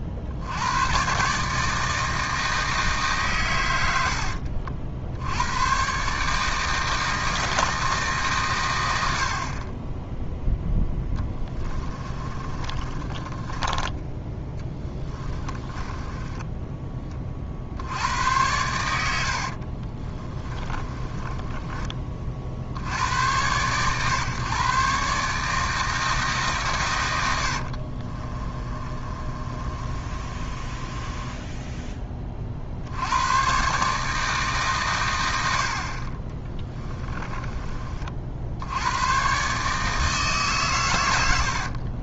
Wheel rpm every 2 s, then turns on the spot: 100, 160, 70, 160, 100, 0, 30, 20, 20, 100, 20, 70, 140, 120, 30, 20, 70, 140, 30, 90, 130.
12-16 20-22 28-32 36-38